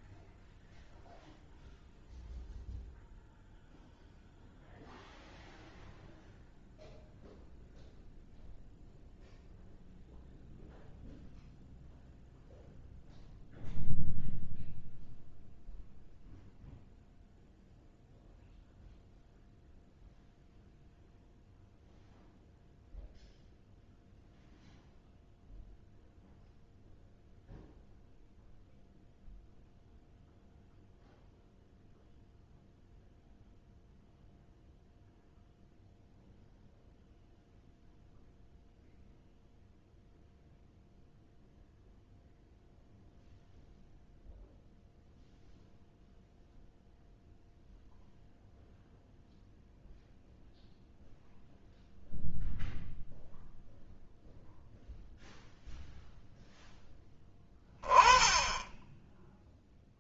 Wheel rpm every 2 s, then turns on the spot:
0, 0, 0, 0, 0, 0, 0, 0, 0, 0, 0, 0, 0, 0, 0, 0, 0, 0, 0, 0, 0, 0, 0, 0, 0, 0, 0, 0, 0, 10.
none